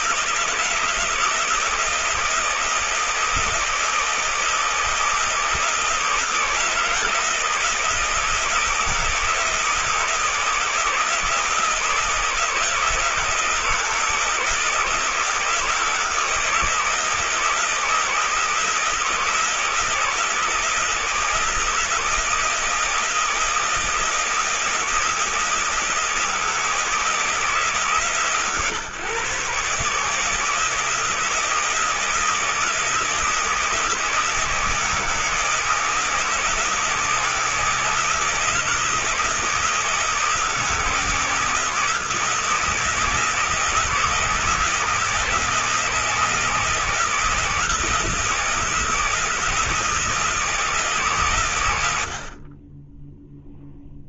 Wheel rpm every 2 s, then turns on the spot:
160, 160, 160, 160, 160, 160, 160, 160, 160, 160, 160, 160, 160, 160, 130, 150, 160, 160, 160, 160, 160, 160, 160, 160, 160, 160, 30.
none